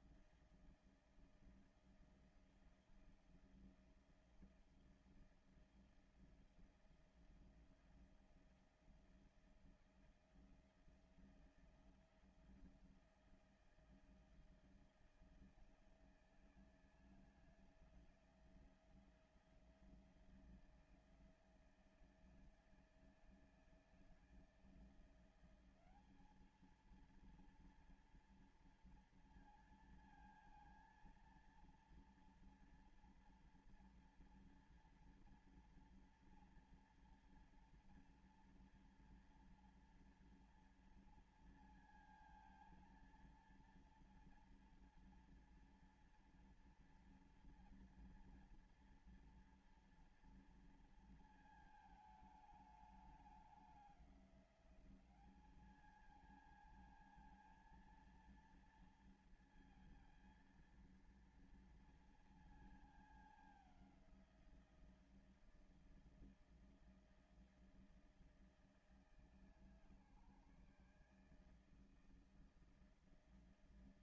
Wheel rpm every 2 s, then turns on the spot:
160, 160, 160, 170, 170, 160, 170, 160, 160, 160, 160, 160, 160, 200, 230, 230, 230, 240, 240, 230, 230, 230, 230, 230, 230, 230, 220, 200, 220, 230, 230, 230, 180, 160, 160, 140, 160.
none